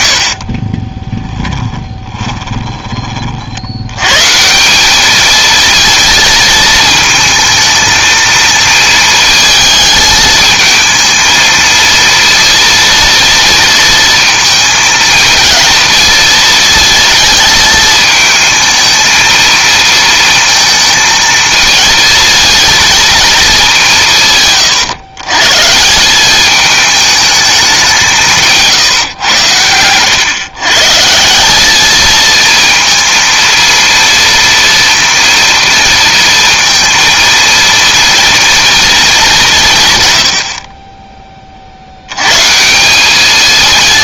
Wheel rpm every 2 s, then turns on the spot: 30, 20, 190, 220, 220, 220, 230, 220, 230, 220, 230, 220, 110, 210, 160, 140, 230, 230, 230, 230, 40, 160.
0-2